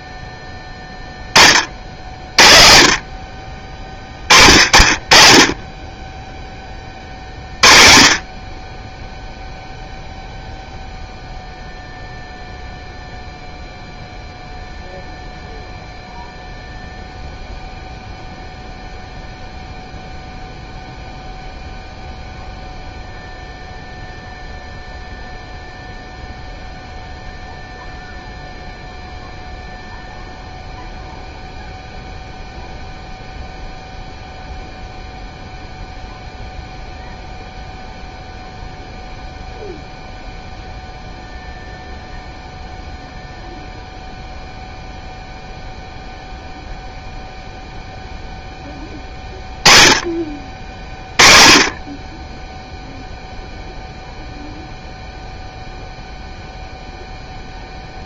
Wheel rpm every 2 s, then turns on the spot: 10, 50, 40, 20, 20, 0, 0, 0, 0, 0, 0, 0, 0, 0, 0, 0, 0, 0, 0, 0, 0, 0, 0, 0, 10, 30, 0, 0, 0.
none